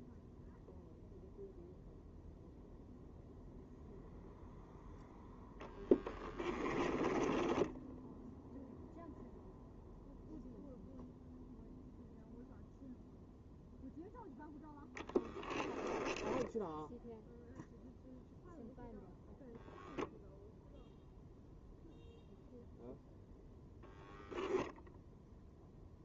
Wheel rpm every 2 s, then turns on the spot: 0, 0, 0, 10, 0, 0, 0, 0, 10, 0, 0, 0, 0.
6-8